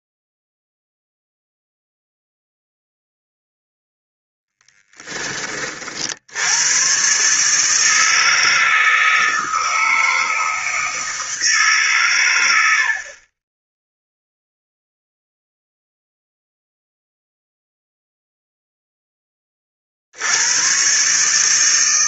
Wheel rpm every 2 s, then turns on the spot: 0, 0, 0, 100, 160, 160, 80, 0, 0, 0, 110.
none